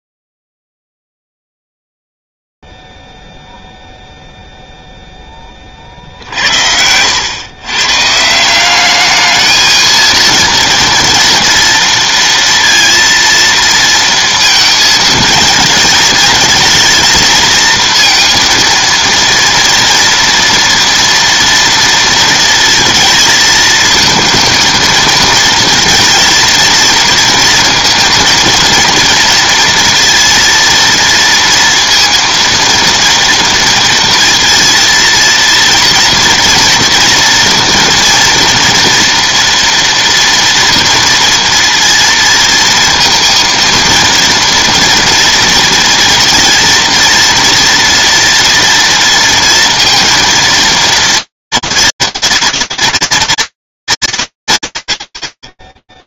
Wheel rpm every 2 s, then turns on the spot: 0, 0, 0, 50, 150, 230, 230, 230, 220, 230, 240, 230, 220, 230, 230, 230, 230, 230, 240, 230, 230, 230, 230, 230, 230, 230, 230, 170.
none